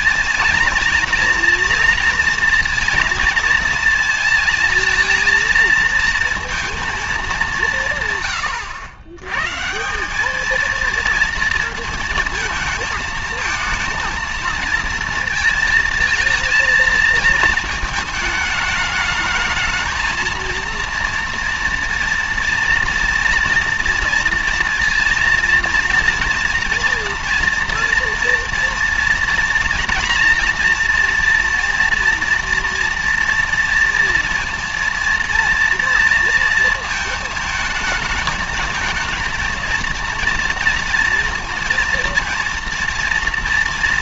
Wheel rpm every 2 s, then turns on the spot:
230, 230, 230, 230, 100, 230, 220, 230, 220, 210, 230, 230, 230, 230, 230, 230, 230, 230, 230, 220, 230, 230.
none